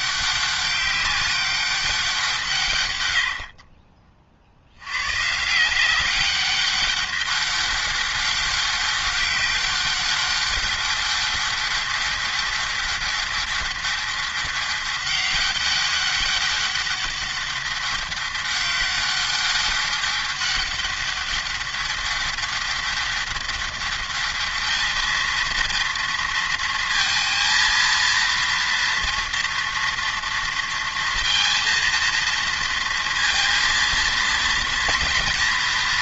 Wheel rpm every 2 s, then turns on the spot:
190, 130, 90, 200, 200, 200, 200, 200, 200, 200, 200, 200, 210, 230, 230, 230, 230, 230.
none